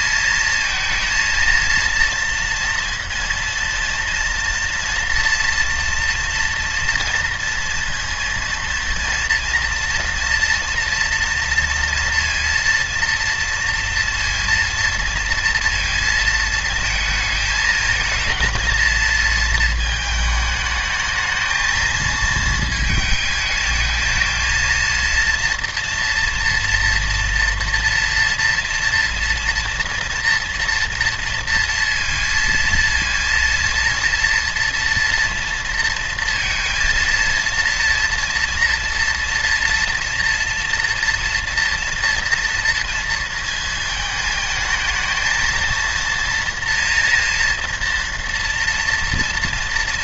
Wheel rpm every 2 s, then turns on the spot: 220, 230, 230, 230, 230, 230, 230, 230, 230, 230, 220, 220, 230, 230, 230, 230, 230, 230, 230, 230, 230, 230, 220, 230, 240.
none